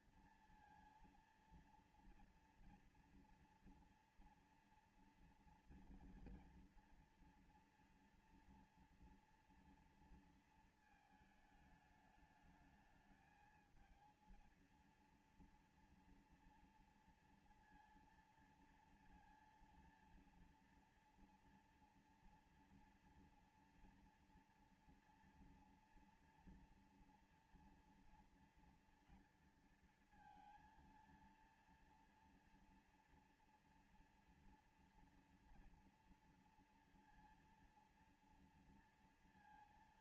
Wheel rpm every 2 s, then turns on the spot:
230, 240, 230, 240, 230, 230, 220, 230, 240, 230, 230, 230, 230, 230, 230, 230, 230, 230, 230, 230.
none